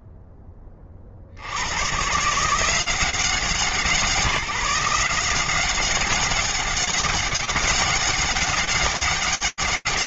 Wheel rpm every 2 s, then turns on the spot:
20, 180, 180, 200, 200.
none